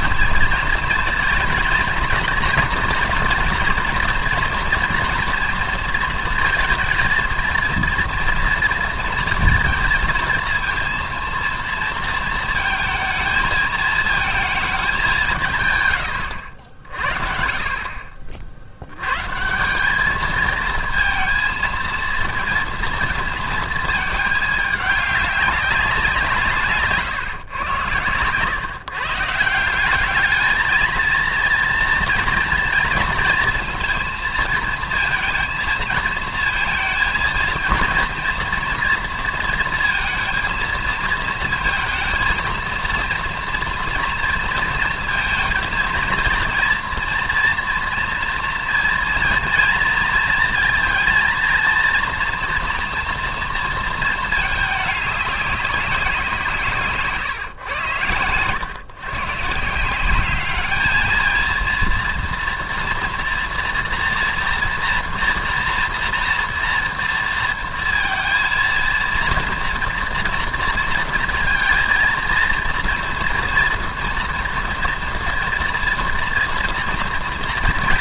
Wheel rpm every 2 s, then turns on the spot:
230, 230, 230, 230, 230, 230, 230, 210, 60, 90, 220, 230, 210, 150, 140, 220, 230, 230, 230, 230, 230, 230, 230, 240, 230, 230, 240, 200, 140, 120, 210, 230, 240, 230, 230, 230, 230, 230, 230.
none